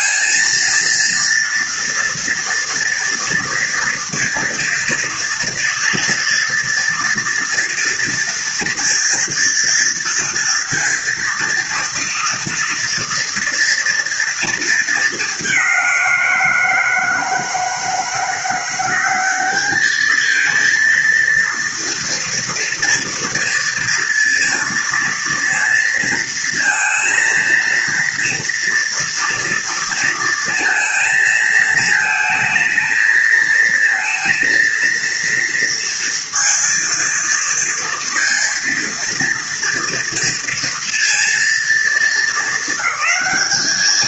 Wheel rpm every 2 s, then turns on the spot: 230, 230, 230, 230, 230, 230, 230, 230, 170, 170, 220, 230, 230, 230, 230, 230, 220, 230, 230, 230, 230, 220.
none